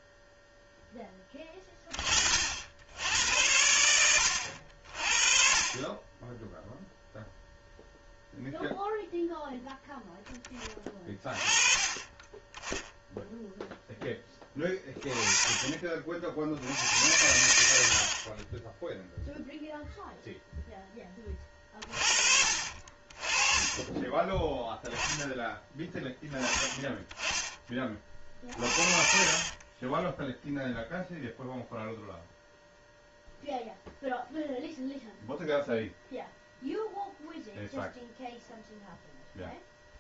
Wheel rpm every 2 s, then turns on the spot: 0, 70, 70, 0, 0, 20, 20, 20, 60, 20, 0, 40, 10, 20, 40, 0, 0, 0, 0, 0.
28-30